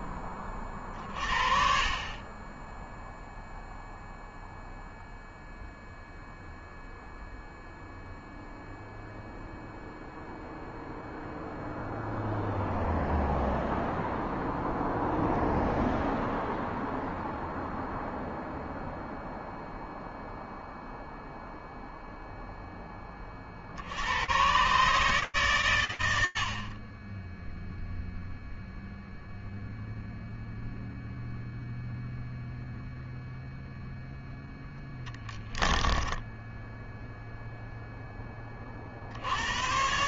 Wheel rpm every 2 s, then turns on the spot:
40, 0, 0, 0, 0, 0, 0, 0, 0, 0, 0, 10, 140, 40, 0, 0, 0, 10, 0, 70.
34-36